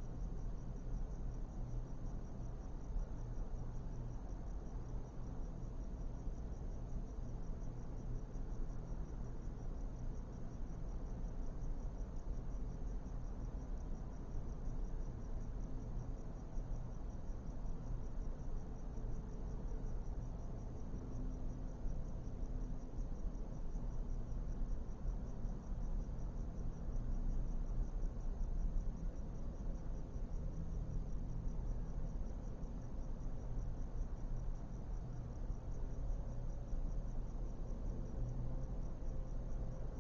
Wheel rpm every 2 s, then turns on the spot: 0, 0, 0, 0, 0, 0, 0, 0, 0, 0, 0, 0, 0, 0, 0, 0, 0, 0, 0, 0.
none